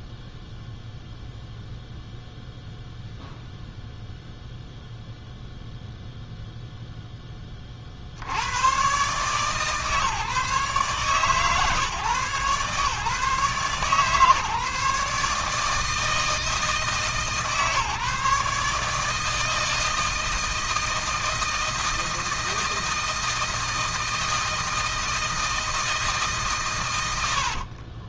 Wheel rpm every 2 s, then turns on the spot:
0, 0, 0, 10, 130, 130, 140, 150, 150, 150, 160, 160, 160, 90.
26-28